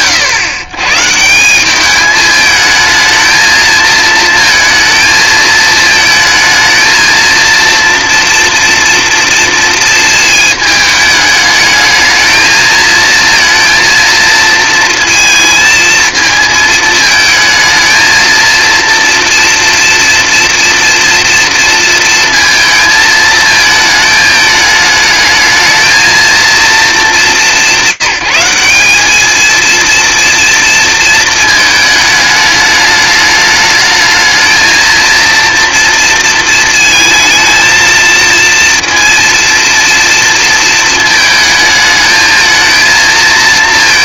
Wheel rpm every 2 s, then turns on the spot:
130, 220, 220, 230, 230, 210, 230, 230, 220, 230, 230, 220, 220, 170, 230, 220, 210, 230, 220, 230, 220, 220.
none